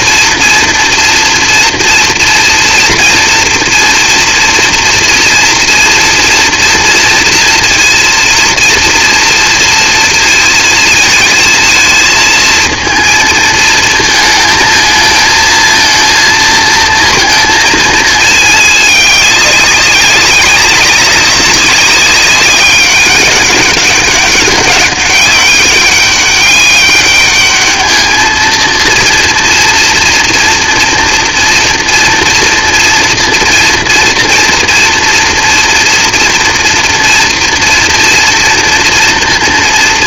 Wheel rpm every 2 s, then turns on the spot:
240, 230, 230, 240, 230, 230, 220, 220, 230, 210, 200, 200, 200, 200, 230, 240, 240, 230, 230, 230.
none